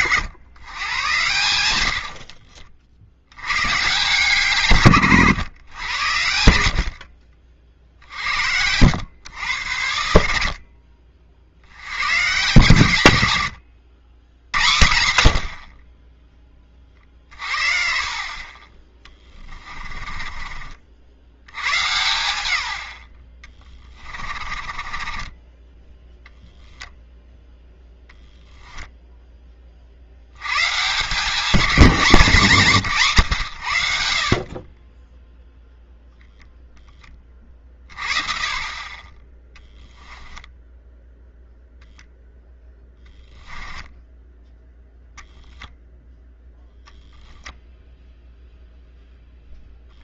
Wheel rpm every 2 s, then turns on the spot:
100, 60, 120, 40, 80, 40, 110, 90, 30, 30, 50, 80, 30, 0, 0, 140, 170, 20, 20, 30, 0, 0, 10, 0, 0.
18-20 24-26